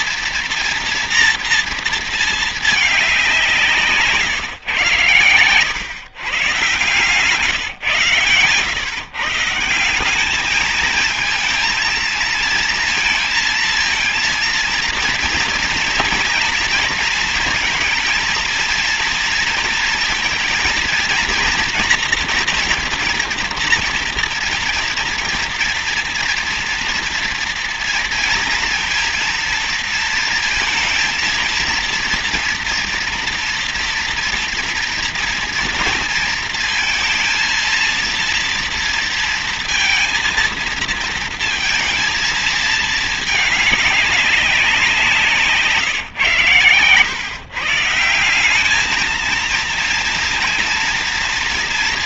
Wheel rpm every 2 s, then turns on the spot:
230, 220, 120, 140, 140, 210, 230, 230, 230, 230, 230, 240, 240, 240, 230, 230, 230, 230, 230, 230, 230, 220, 200, 120, 190, 230.
none